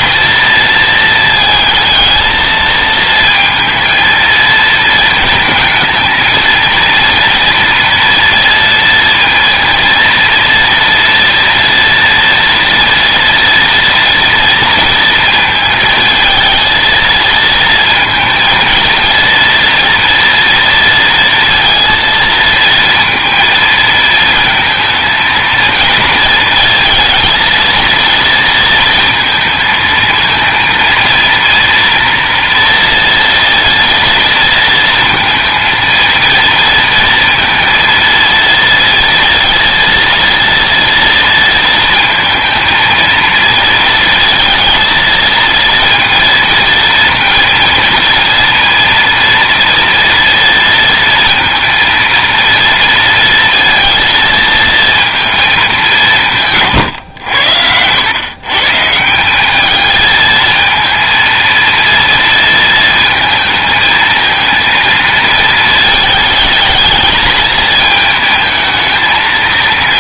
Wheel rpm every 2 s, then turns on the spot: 230, 220, 230, 230, 230, 230, 240, 230, 230, 230, 230, 230, 220, 230, 230, 230, 230, 230, 230, 230, 230, 230, 230, 230, 230, 230, 230, 230, 130, 150, 230, 230, 230, 220, 220.
none